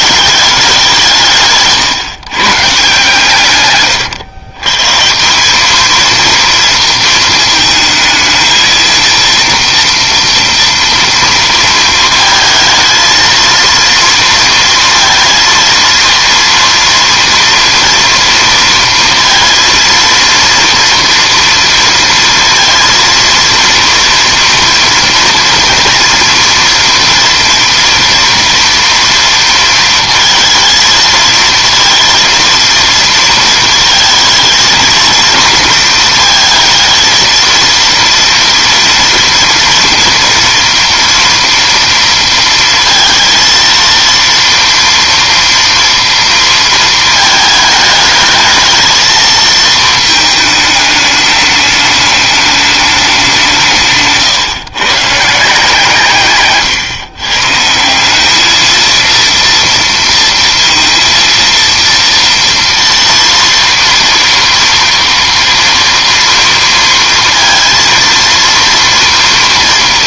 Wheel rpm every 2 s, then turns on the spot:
190, 150, 130, 230, 220, 230, 220, 230, 230, 230, 230, 230, 230, 230, 230, 220, 230, 220, 230, 230, 230, 230, 230, 230, 220, 210, 210, 140, 150, 220, 230, 240, 240, 230, 230.
none